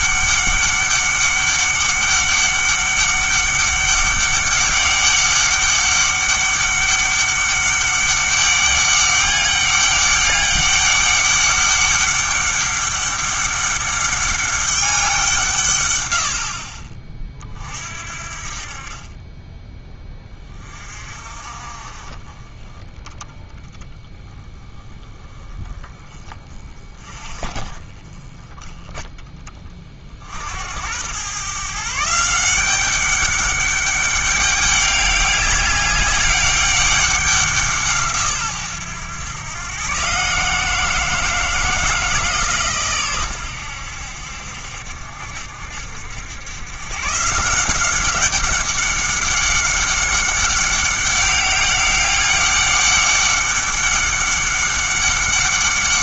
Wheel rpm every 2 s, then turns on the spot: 200, 200, 200, 200, 200, 200, 200, 200, 50, 50, 30, 30, 20, 20, 20, 80, 190, 200, 200, 120, 160, 140, 60, 110, 200, 200, 200, 200.
none